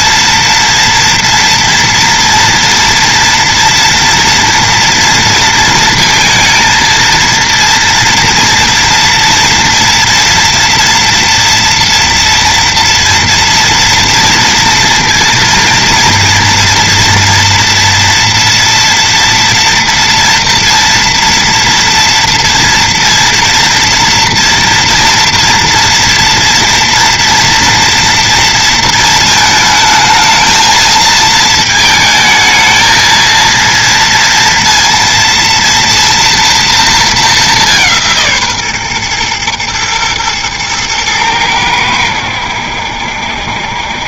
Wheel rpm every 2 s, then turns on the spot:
230, 240, 230, 230, 230, 230, 230, 230, 230, 230, 230, 230, 230, 230, 230, 220, 220, 230, 230, 140, 110, 80.
none